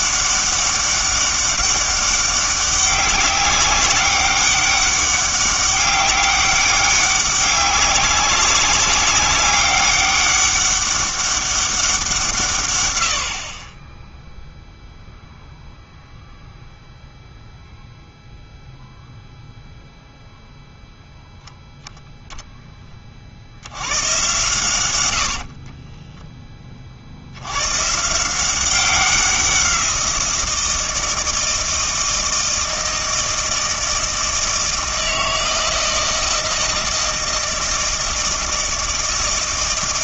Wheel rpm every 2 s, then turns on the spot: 200, 200, 200, 200, 200, 200, 130, 0, 0, 0, 0, 10, 100, 30, 180, 170, 160, 160, 160, 160.
none